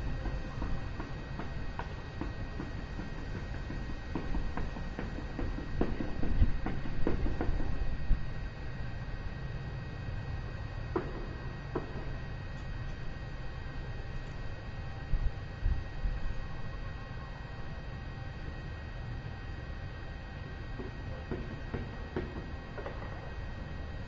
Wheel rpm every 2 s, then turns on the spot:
0, 0, 0, 0, 0, 0, 0, 0, 0, 0, 0, 0.
none